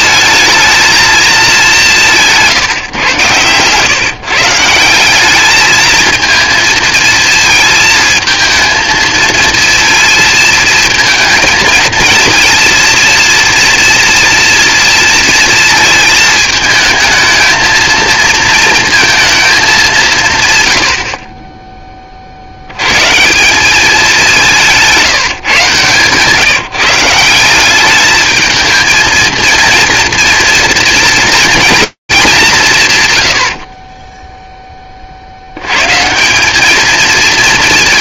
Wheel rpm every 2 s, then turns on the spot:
220, 150, 170, 230, 220, 230, 230, 230, 220, 230, 110, 110, 180, 160, 220, 230, 110, 20, 220.
24-26